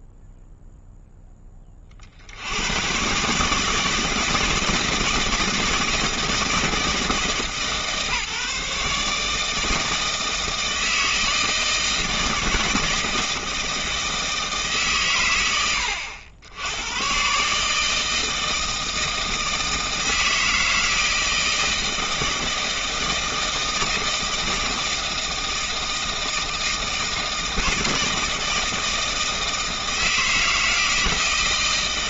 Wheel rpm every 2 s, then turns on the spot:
0, 110, 160, 160, 150, 160, 160, 130, 120, 160, 160, 160, 160, 160, 160, 160.
none